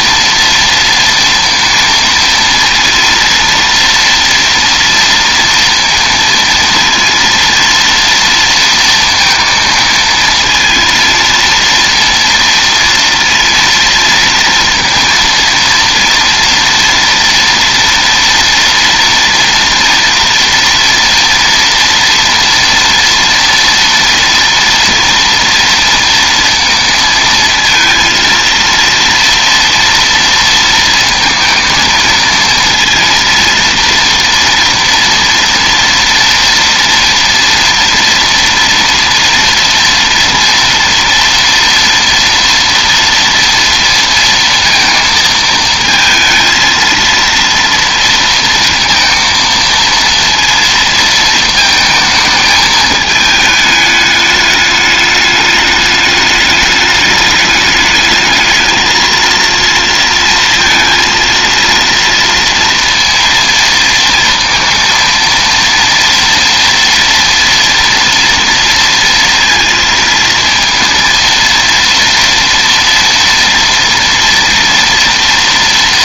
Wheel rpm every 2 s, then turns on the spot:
230, 230, 230, 230, 230, 230, 230, 230, 230, 230, 230, 230, 240, 230, 230, 230, 230, 240, 230, 230, 230, 230, 230, 230, 230, 230, 220, 210, 210, 230, 230, 230, 230, 240, 230, 230, 230, 230.
none